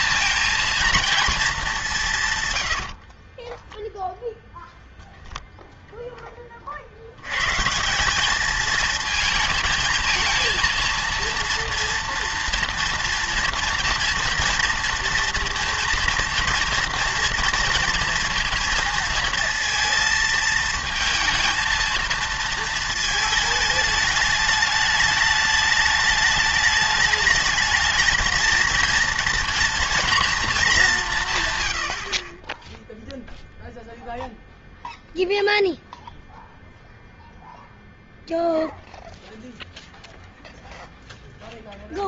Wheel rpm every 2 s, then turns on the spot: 230, 100, 10, 40, 210, 220, 230, 230, 230, 230, 220, 220, 210, 210, 230, 220, 10, 0, 0, 0, 0.
none